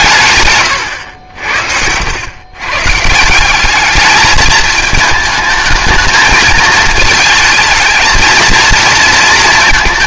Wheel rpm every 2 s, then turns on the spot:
120, 130, 220, 220, 230.
0-2